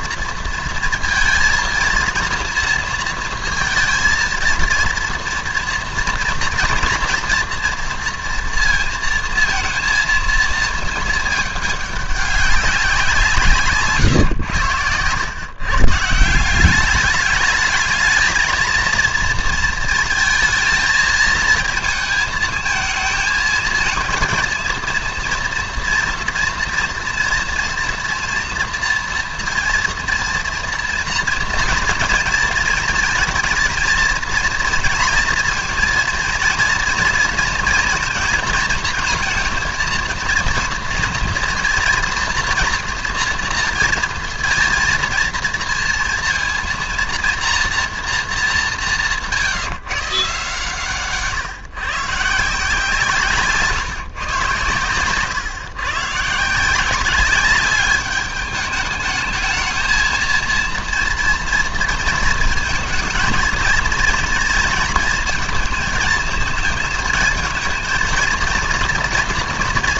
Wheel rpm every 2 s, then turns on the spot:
230, 230, 230, 240, 230, 230, 190, 100, 200, 220, 220, 220, 230, 230, 230, 230, 220, 230, 230, 220, 230, 230, 230, 230, 190, 140, 160, 120, 170, 210, 230, 220, 230, 220, 230.
none